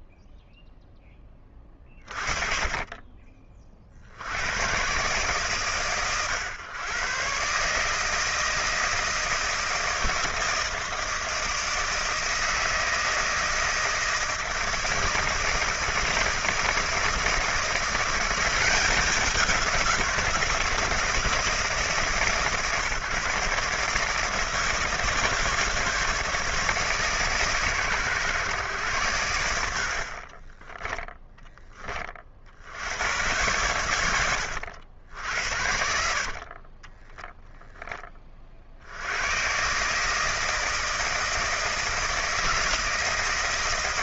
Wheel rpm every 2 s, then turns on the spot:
20, 30, 130, 130, 160, 160, 160, 160, 170, 190, 160, 150, 160, 150, 110, 10, 90, 70, 20, 80, 160, 160.
0-2 30-32 36-38